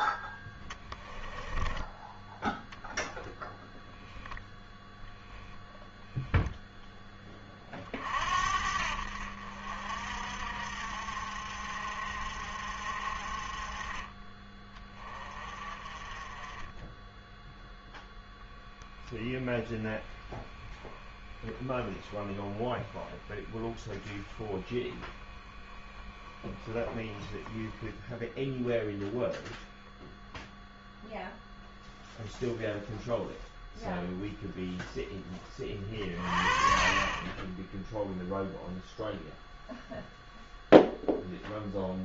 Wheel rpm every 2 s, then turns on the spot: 10, 0, 0, 10, 60, 60, 50, 20, 10, 0, 20, 20, 10, 10, 0, 0, 0, 0, 30, 0, 0.
0-2 20-28